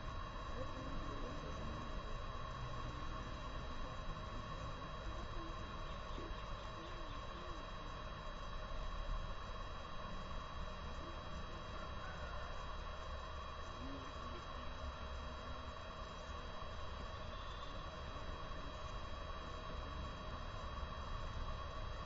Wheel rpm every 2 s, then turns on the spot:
0, 0, 0, 0, 0, 0, 0, 0, 0, 0, 0.
none